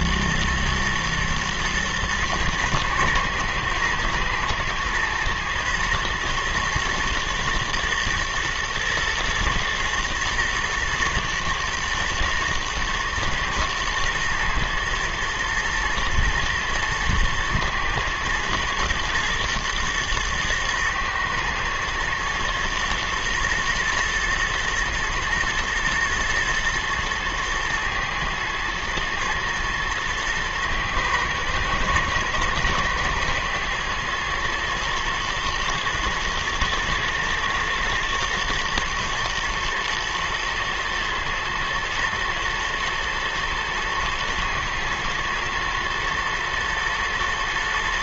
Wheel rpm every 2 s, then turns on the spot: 120, 110, 110, 120, 120, 120, 120, 110, 110, 110, 110, 120, 120, 120, 110, 110, 110, 110, 110, 120, 110, 110, 120, 120.
none